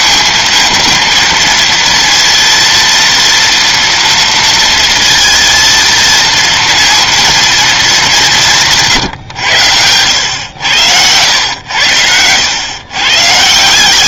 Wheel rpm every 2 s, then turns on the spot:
230, 230, 230, 230, 160, 100, 110.
none